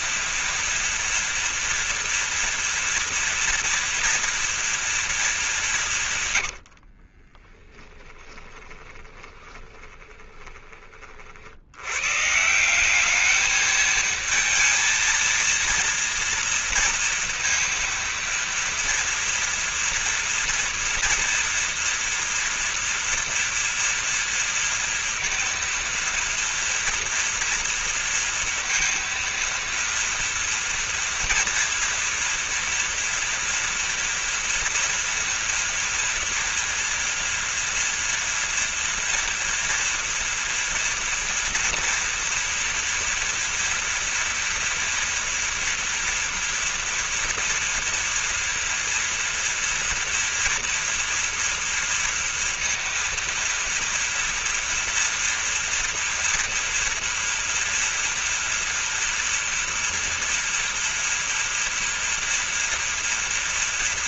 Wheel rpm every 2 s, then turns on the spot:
230, 230, 230, 70, 20, 30, 190, 230, 230, 240, 230, 230, 230, 230, 230, 230, 230, 240, 240, 230, 240, 230, 240, 240, 230, 230, 230, 230, 240, 230, 230, 230.
6-10